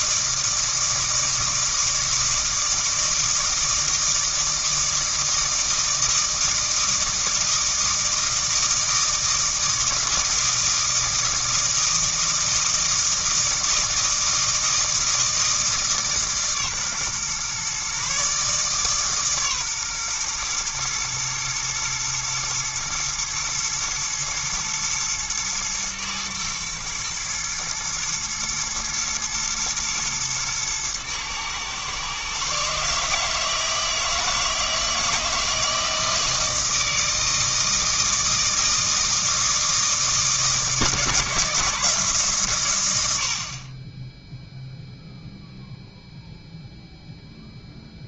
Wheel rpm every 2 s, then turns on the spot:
160, 160, 160, 160, 160, 160, 160, 160, 140, 140, 120, 120, 110, 110, 110, 110, 150, 160, 160, 160, 160, 90, 0, 0.
none